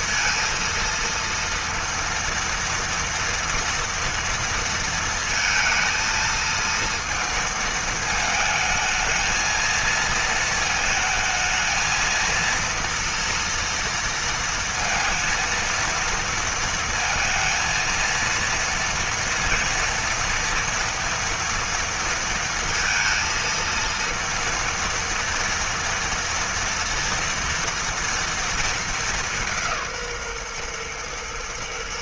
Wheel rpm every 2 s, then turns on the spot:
230, 230, 230, 230, 220, 220, 230, 230, 230, 230, 230, 230, 230, 230, 200, 120.
none